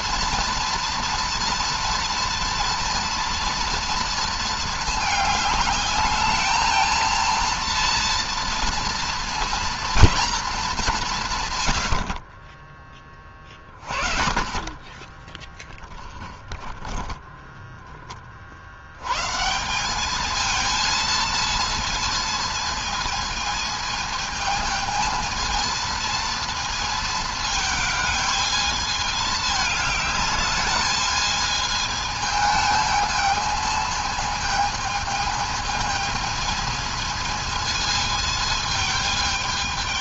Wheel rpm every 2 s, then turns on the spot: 230, 230, 210, 220, 230, 190, 20, 20, 10, 50, 220, 230, 220, 230, 220, 210, 220, 220, 220, 220.
none